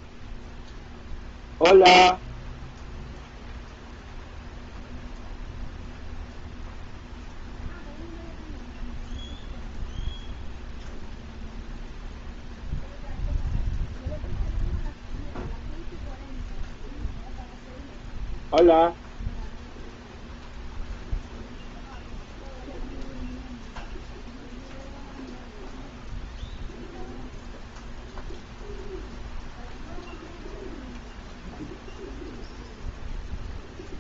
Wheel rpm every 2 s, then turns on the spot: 0, 0, 0, 0, 0, 0, 0, 0, 0, 0, 0, 0, 0, 0, 0, 0, 0.
none